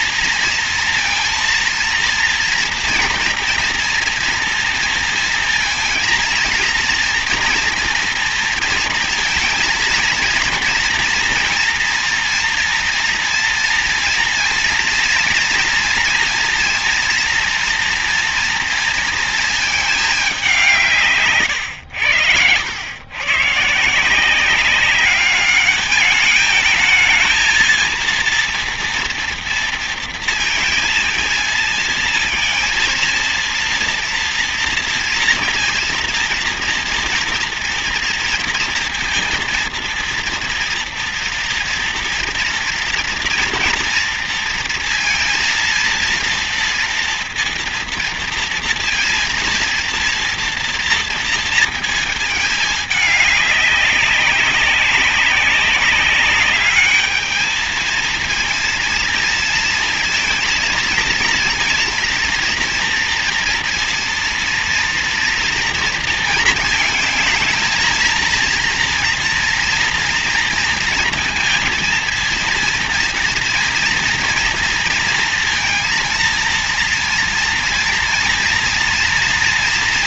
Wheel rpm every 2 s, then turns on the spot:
230, 240, 230, 230, 230, 230, 230, 230, 230, 230, 190, 90, 180, 210, 230, 230, 230, 230, 230, 230, 230, 230, 230, 230, 230, 230, 220, 190, 200, 230, 230, 230, 230, 220, 230, 230, 230, 230, 230, 230.
none